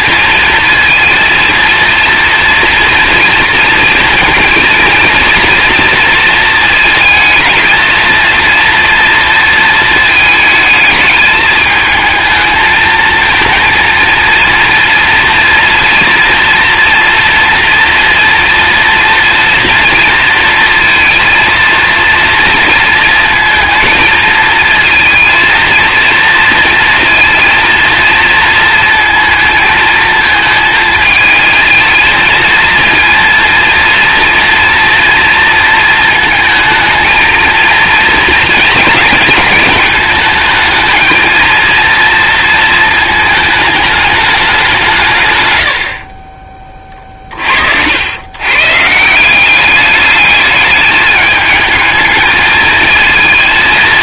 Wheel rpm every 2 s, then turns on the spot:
230, 230, 230, 220, 230, 220, 230, 230, 230, 230, 230, 230, 230, 230, 220, 220, 220, 230, 220, 220, 220, 230, 160, 30, 140, 210, 230.
46-48